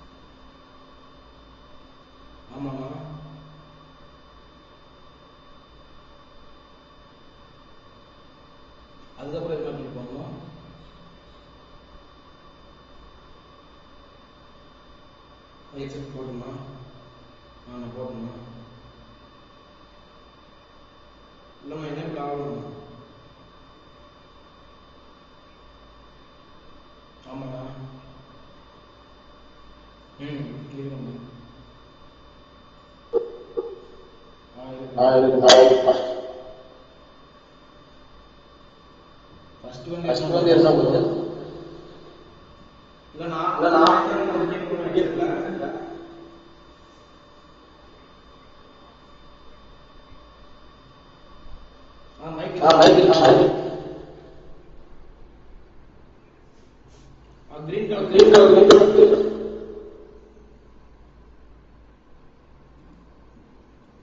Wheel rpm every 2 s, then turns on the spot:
0, 0, 0, 0, 0, 0, 0, 0, 0, 0, 0, 0, 0, 0, 0, 0, 0, 0, 0, 0, 0, 0, 0, 0, 0, 0, 0, 0, 0, 0, 0, 0.
none